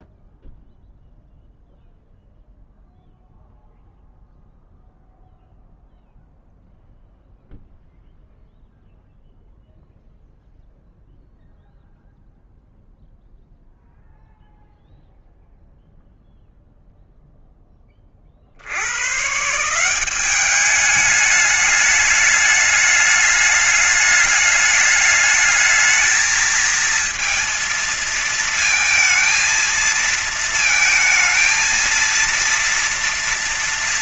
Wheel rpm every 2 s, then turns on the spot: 0, 0, 0, 0, 0, 0, 0, 0, 0, 70, 200, 210, 210, 220, 220, 220, 230.
none